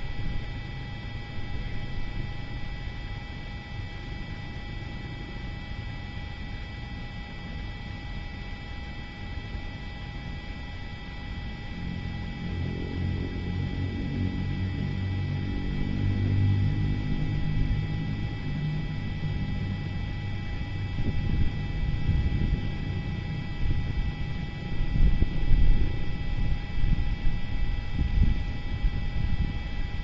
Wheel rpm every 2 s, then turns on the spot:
0, 0, 0, 0, 0, 0, 0, 0, 0, 0, 0, 0, 0, 0, 0.
none